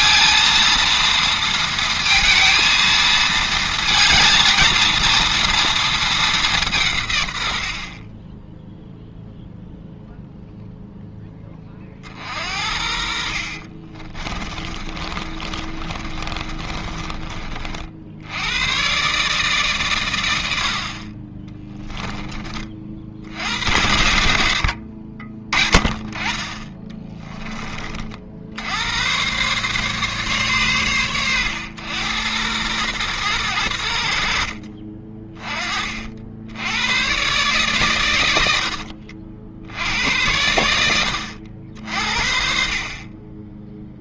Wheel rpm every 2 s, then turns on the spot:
230, 220, 230, 160, 0, 0, 50, 30, 30, 120, 50, 50, 70, 20, 100, 120, 110, 40, 100, 70, 80, 40.
14-18 26-28 38-40